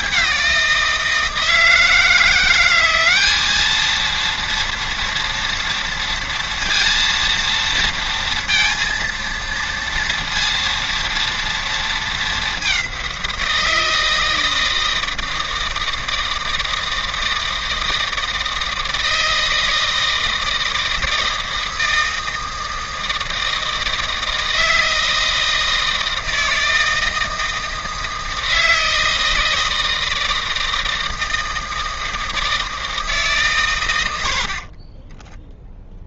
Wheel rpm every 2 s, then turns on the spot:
180, 180, 230, 230, 230, 230, 200, 160, 160, 160, 160, 160, 160, 160, 160, 160, 160, 70.
none